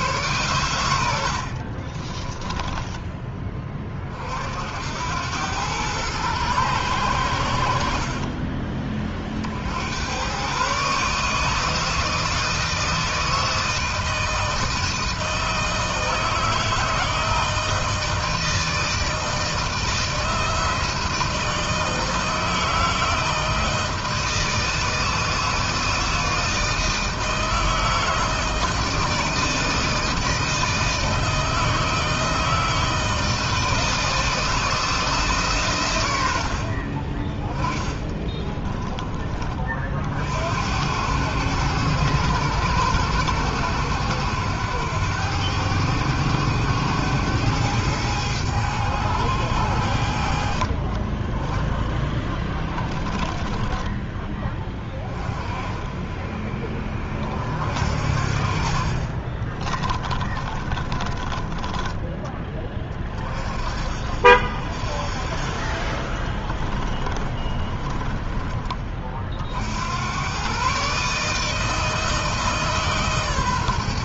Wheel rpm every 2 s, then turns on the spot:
110, 10, 70, 110, 40, 130, 160, 160, 160, 160, 160, 160, 160, 160, 160, 160, 160, 160, 70, 30, 80, 100, 100, 100, 100, 50, 10, 20, 30, 40, 30, 20, 50, 20, 30, 130, 150.
2-4 58-62 66-68